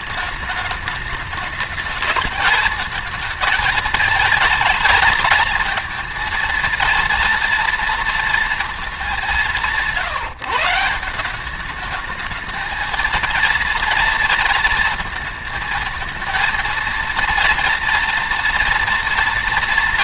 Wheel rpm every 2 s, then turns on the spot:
210, 220, 220, 230, 220, 160, 220, 230, 230, 230.
none